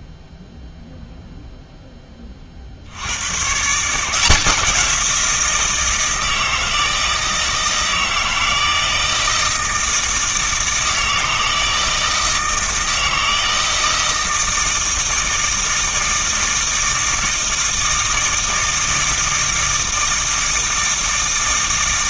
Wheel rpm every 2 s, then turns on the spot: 0, 50, 180, 160, 160, 160, 160, 160, 160, 160, 160.
none